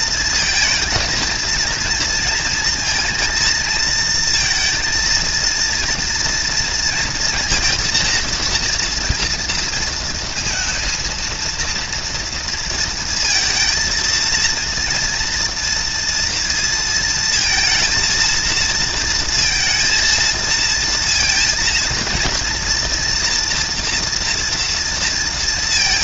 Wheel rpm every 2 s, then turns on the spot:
220, 220, 230, 230, 230, 230, 230, 230, 230, 230, 230, 230, 230.
none